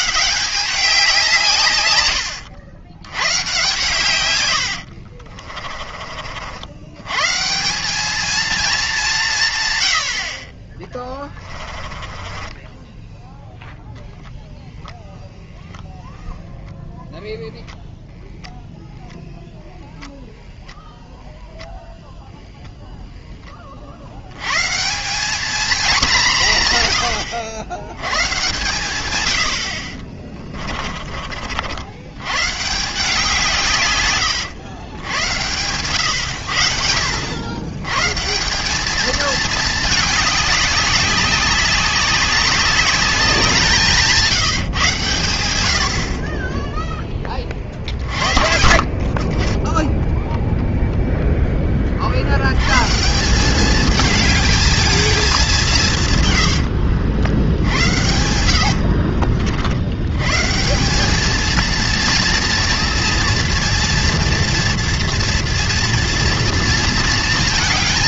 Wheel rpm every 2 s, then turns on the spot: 190, 90, 80, 110, 210, 20, 10, 0, 10, 0, 0, 0, 160, 100, 120, 30, 170, 110, 70, 200, 200, 190, 130, 10, 40, 0, 130, 220, 70, 70, 170, 230, 230, 230.
4-6 10-14 30-32 56-60